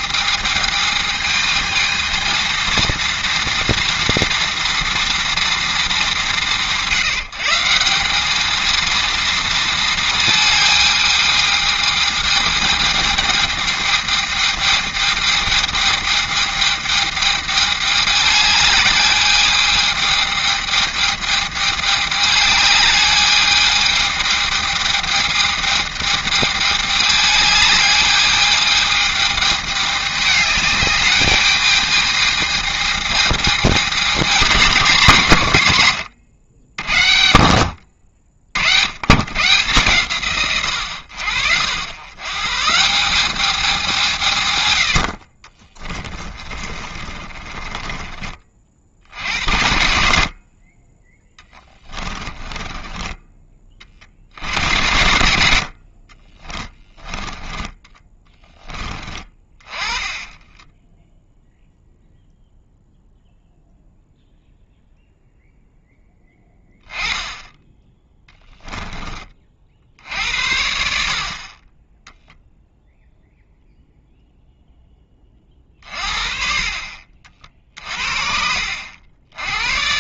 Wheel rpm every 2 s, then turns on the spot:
220, 230, 230, 140, 220, 220, 220, 220, 210, 210, 210, 210, 220, 210, 220, 210, 220, 220, 70, 80, 100, 170, 90, 30, 50, 30, 20, 70, 20, 10, 10, 0, 0, 10, 10, 70, 0, 10, 50, 60.
46-48 52-54 56-58 60-62